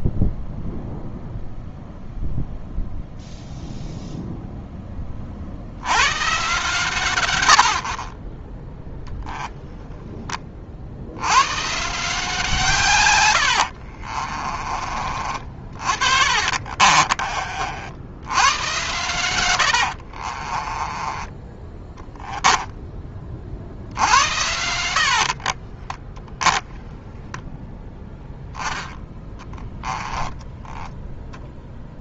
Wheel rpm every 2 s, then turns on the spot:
0, 0, 10, 130, 10, 50, 140, 30, 40, 120, 20, 10, 70, 10, 10, 10.
8-10 16-18 20-22